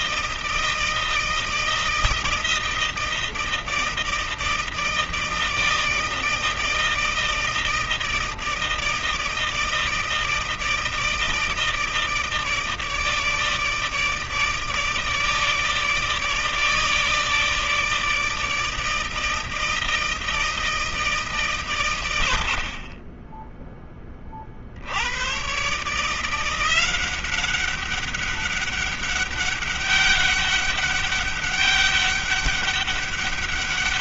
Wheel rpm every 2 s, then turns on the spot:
160, 160, 160, 160, 160, 160, 150, 160, 160, 160, 160, 40, 80, 180, 200, 200, 200.
none